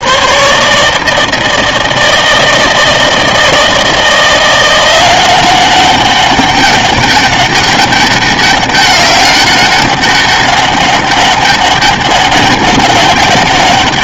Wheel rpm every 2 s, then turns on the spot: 150, 160, 180, 200, 200, 200, 200.
none